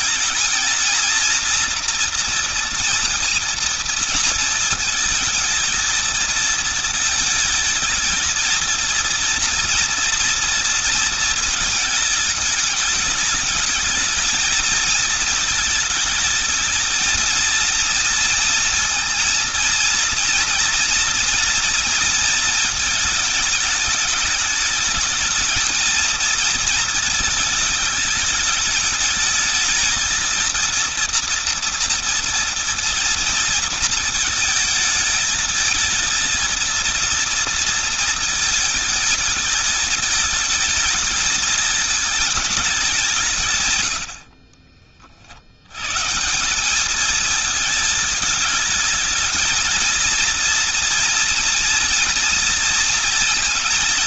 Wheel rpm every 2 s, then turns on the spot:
230, 230, 220, 220, 230, 230, 210, 220, 220, 230, 230, 220, 220, 220, 220, 230, 230, 220, 230, 220, 210, 180, 40, 210, 220, 230, 230.
none